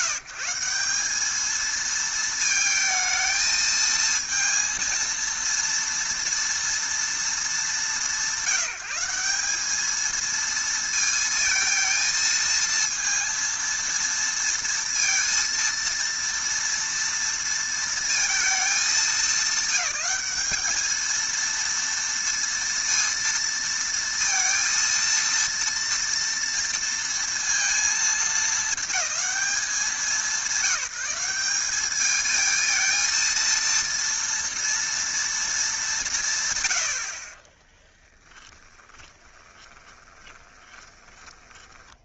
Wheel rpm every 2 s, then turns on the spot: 180, 220, 230, 230, 190, 230, 230, 230, 230, 220, 220, 230, 230, 230, 220, 190, 230, 230, 90, 20, 20.
38-42